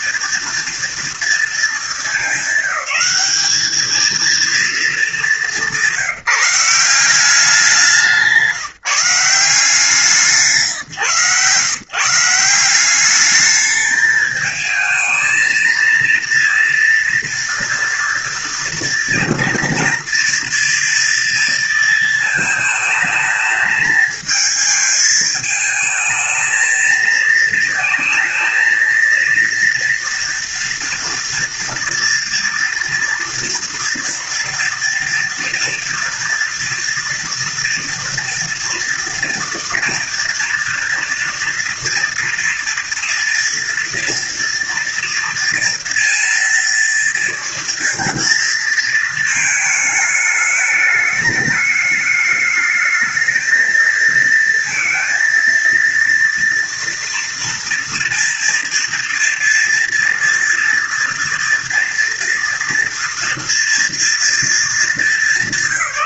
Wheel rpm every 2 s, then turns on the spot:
230, 200, 210, 180, 170, 140, 190, 220, 230, 230, 230, 220, 220, 220, 230, 240, 230, 230, 230, 230, 230, 230, 230, 230, 220, 210, 220, 230, 230, 230, 230, 240, 210.
none